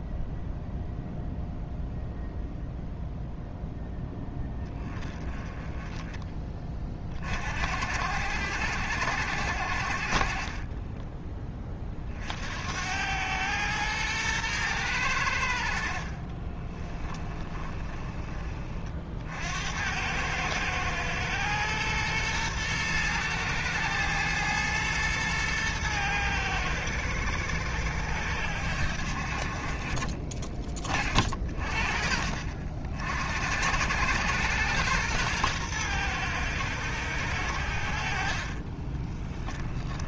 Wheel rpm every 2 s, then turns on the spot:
0, 0, 20, 20, 70, 30, 70, 110, 30, 30, 110, 110, 110, 110, 80, 30, 50, 110, 110, 40.
10-12 16-18 38-40